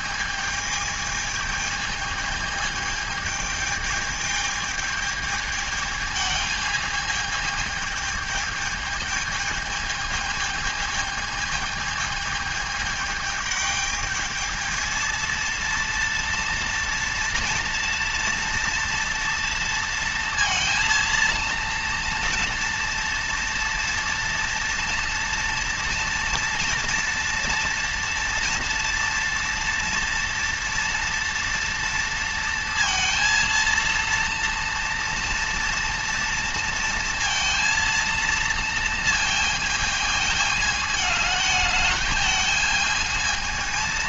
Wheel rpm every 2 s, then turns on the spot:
220, 220, 220, 220, 220, 220, 210, 220, 230, 230, 230, 230, 230, 230, 230, 230, 230, 240, 230, 230, 210, 220.
none